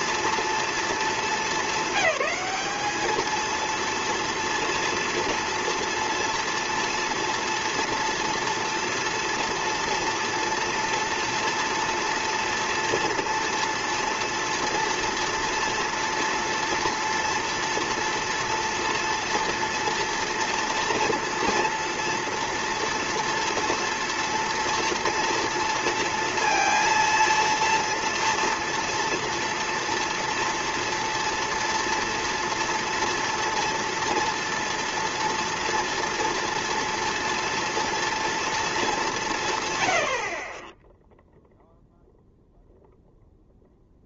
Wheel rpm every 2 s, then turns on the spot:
220, 210, 230, 230, 230, 230, 230, 230, 230, 230, 230, 230, 230, 230, 230, 240, 230, 230, 230, 220, 10, 0.
none